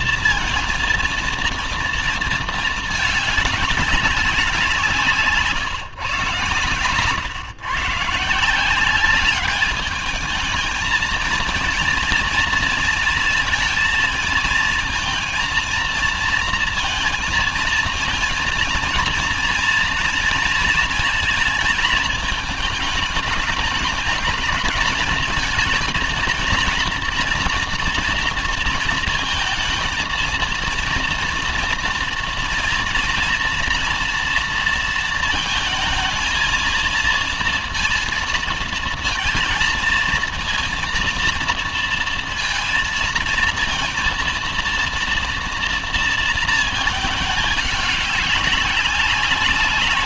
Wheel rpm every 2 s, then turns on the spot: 230, 220, 170, 130, 180, 220, 230, 220, 230, 230, 230, 220, 210, 230, 230, 230, 240, 230, 220, 230, 230, 230, 230, 220, 200.
none